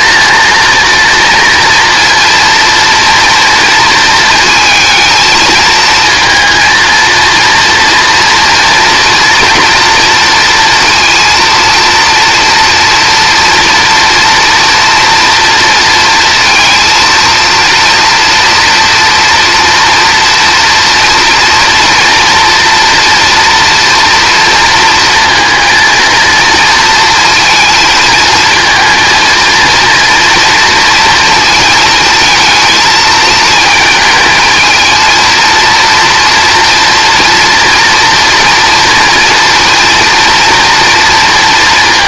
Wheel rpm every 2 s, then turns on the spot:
230, 230, 220, 230, 230, 230, 230, 230, 230, 240, 230, 230, 230, 230, 230, 230, 220, 220, 230, 230, 230.
none